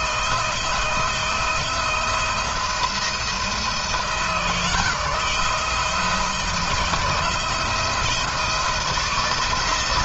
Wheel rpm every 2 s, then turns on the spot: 160, 170, 170, 160, 160.
none